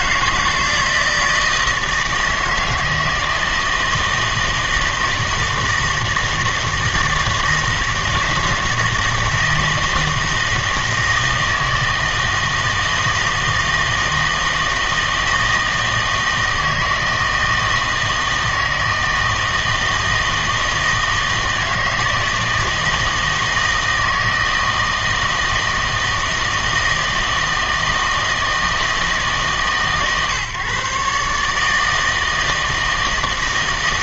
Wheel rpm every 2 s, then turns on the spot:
160, 160, 160, 160, 160, 160, 160, 160, 160, 160, 160, 160, 160, 160, 160, 140, 160.
none